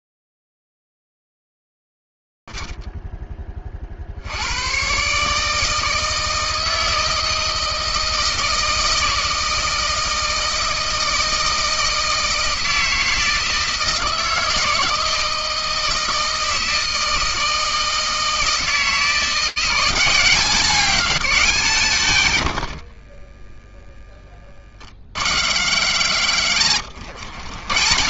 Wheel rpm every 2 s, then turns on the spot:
0, 40, 30, 150, 160, 160, 160, 160, 160, 160, 170, 180, 10, 80.
24-26